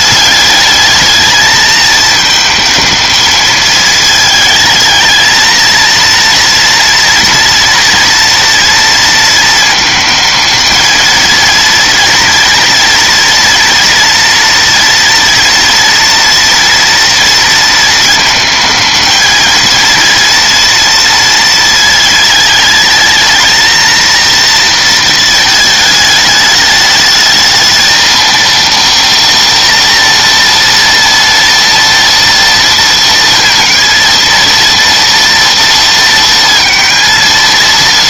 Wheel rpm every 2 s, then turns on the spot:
210, 220, 220, 230, 230, 220, 230, 230, 230, 220, 230, 220, 230, 210, 230, 240, 230, 230, 230.
none